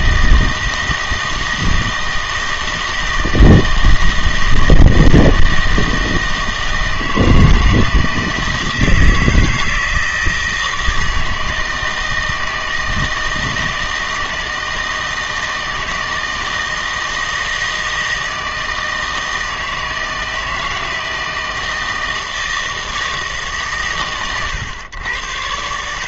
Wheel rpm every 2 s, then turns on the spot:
160, 160, 160, 160, 160, 160, 160, 160, 160, 160, 160, 160, 110.
none